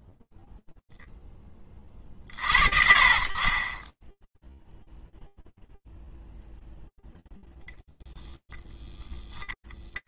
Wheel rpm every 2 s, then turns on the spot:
50, 0, 0, 0, 0.
none